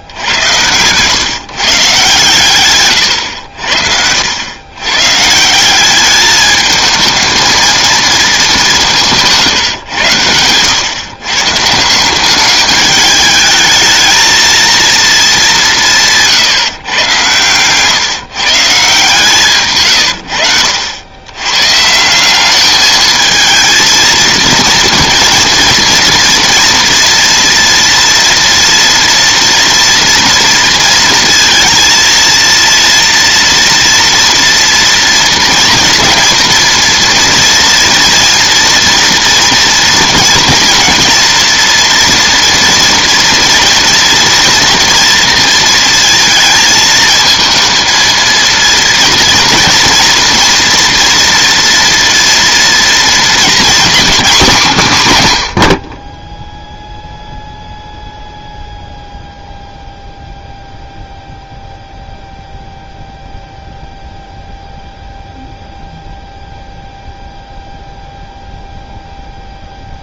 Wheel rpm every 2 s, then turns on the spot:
110, 130, 100, 210, 200, 110, 200, 230, 140, 150, 80, 210, 230, 230, 230, 230, 230, 230, 230, 230, 230, 230, 230, 220, 230, 230, 230, 210, 0, 0, 0, 0, 0, 0, 0.
0-2